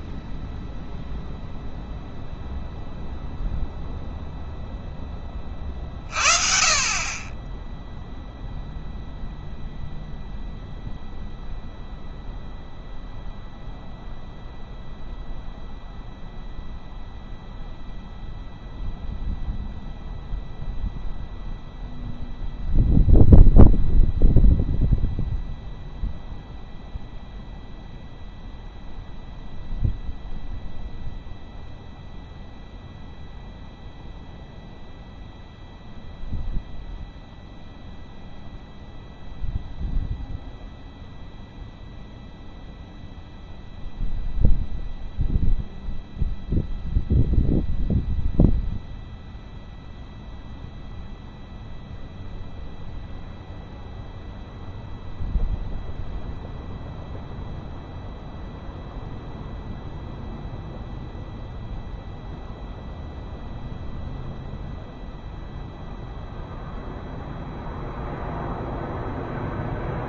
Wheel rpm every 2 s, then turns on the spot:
0, 0, 20, 20, 0, 0, 0, 0, 0, 0, 0, 0, 0, 0, 0, 0, 0, 0, 0, 0, 0, 0, 0, 0, 0, 0, 0, 0, 0, 0, 0, 0, 0, 0, 0.
none